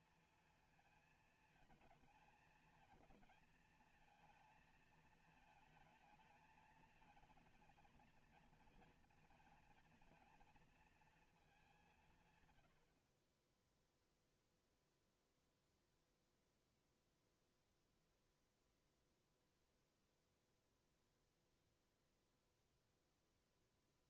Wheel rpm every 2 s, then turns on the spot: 230, 220, 230, 220, 230, 230, 100, 0, 0, 0, 0, 0.
none